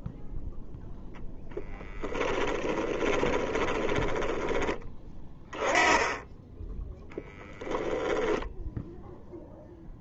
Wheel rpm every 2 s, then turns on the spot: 0, 20, 20, 10, 10.
2-4